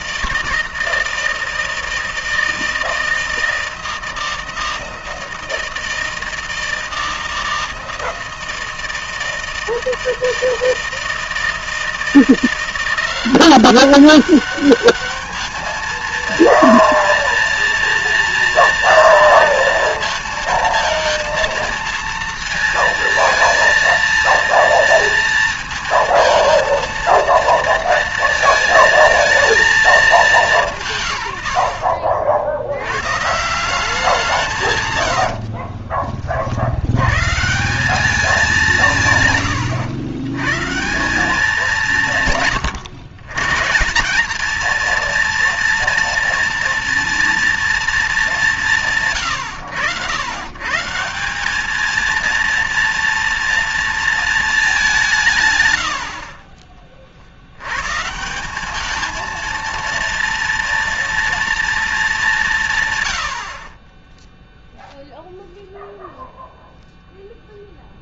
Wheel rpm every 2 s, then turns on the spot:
160, 160, 160, 160, 160, 160, 170, 200, 230, 230, 220, 220, 230, 230, 230, 180, 70, 150, 50, 190, 130, 140, 220, 230, 170, 120, 230, 210, 30, 190, 230, 180, 0, 0.
none